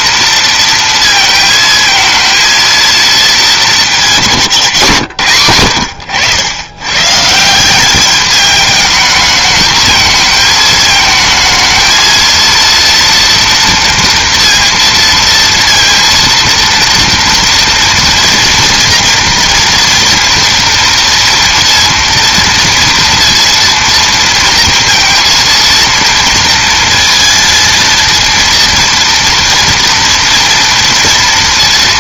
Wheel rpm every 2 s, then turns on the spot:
230, 230, 160, 120, 210, 220, 230, 230, 230, 230, 230, 230, 230, 230, 230, 230.
none